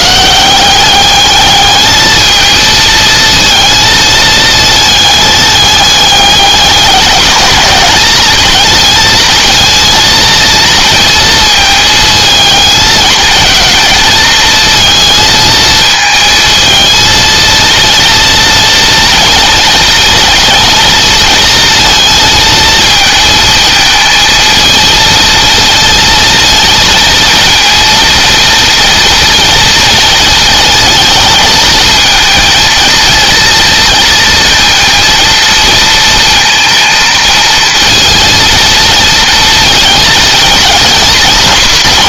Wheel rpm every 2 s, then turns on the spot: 190, 220, 220, 200, 220, 230, 220, 230, 230, 230, 230, 220, 220, 230, 230, 220, 230, 230, 230, 230, 220.
none